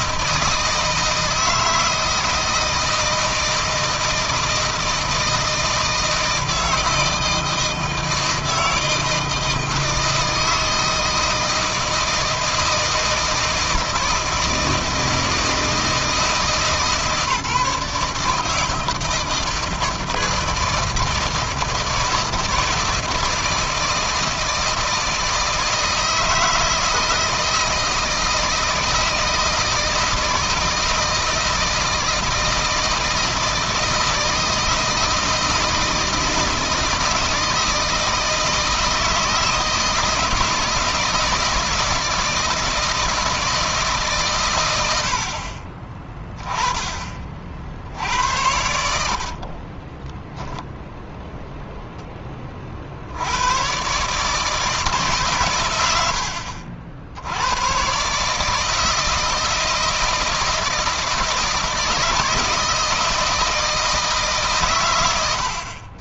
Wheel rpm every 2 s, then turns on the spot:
160, 160, 160, 160, 160, 160, 160, 160, 150, 150, 160, 160, 160, 160, 160, 160, 170, 160, 160, 160, 160, 160, 90, 30, 60, 0, 60, 150, 70, 160, 160, 160, 120.
48-50